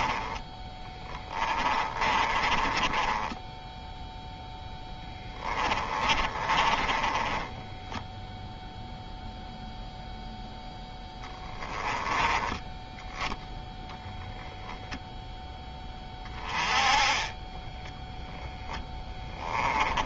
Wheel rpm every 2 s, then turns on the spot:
10, 20, 10, 20, 0, 10, 10, 10, 30, 10.
0-8 18-20